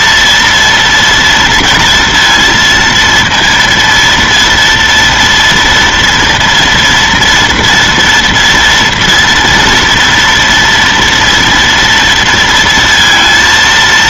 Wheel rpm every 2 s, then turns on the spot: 230, 230, 230, 230, 230, 240, 230.
none